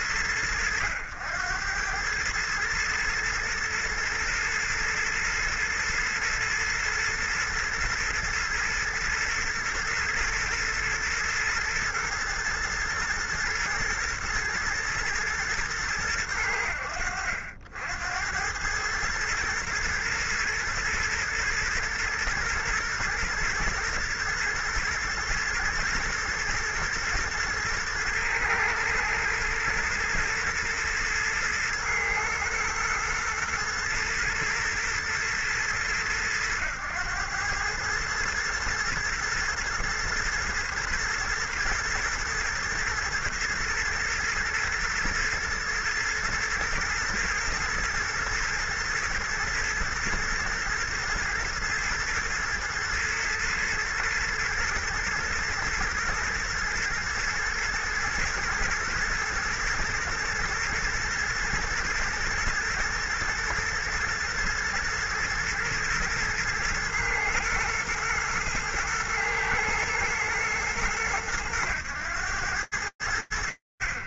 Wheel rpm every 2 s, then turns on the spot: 90, 110, 110, 120, 120, 120, 110, 120, 80, 100, 120, 110, 110, 120, 110, 110, 120, 120, 100, 110, 120, 110, 110, 110, 110, 110, 110, 110, 110, 110, 110, 120, 120, 120, 120, 110, 70.
none